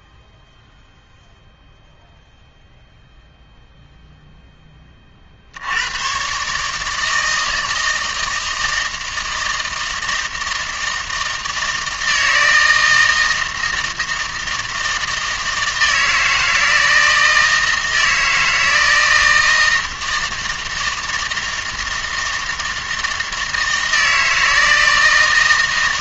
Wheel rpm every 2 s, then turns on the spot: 0, 0, 10, 150, 160, 160, 160, 160, 160, 160, 160, 160, 160.
none